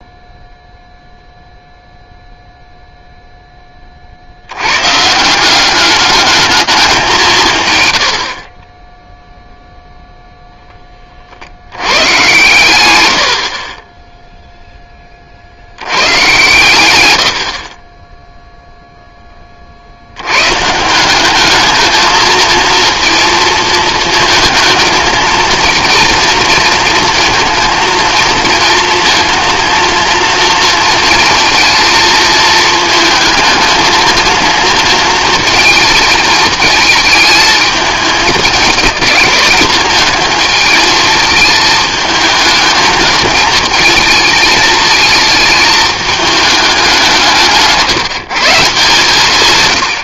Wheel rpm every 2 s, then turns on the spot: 0, 0, 60, 210, 40, 10, 130, 0, 120, 0, 160, 230, 220, 230, 230, 230, 220, 230, 220, 220, 220, 220, 220, 200, 150.
none